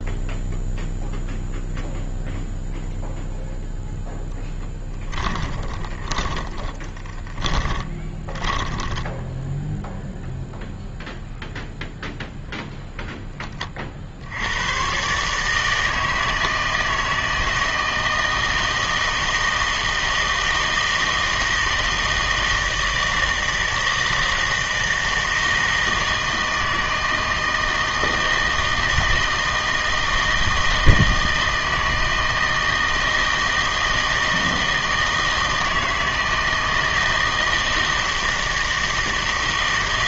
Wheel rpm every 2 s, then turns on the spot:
0, 0, 10, 20, 20, 0, 0, 100, 160, 160, 160, 160, 160, 160, 160, 160, 160, 160, 160, 160.
4-10